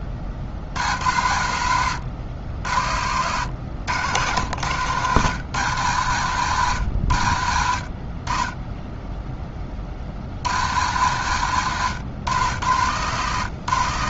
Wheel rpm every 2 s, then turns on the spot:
70, 80, 110, 100, 10, 100, 120.
2-4